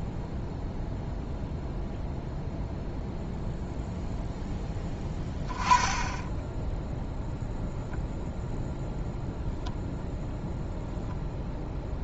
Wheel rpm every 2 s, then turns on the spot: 0, 0, 20, 0, 0, 0.
none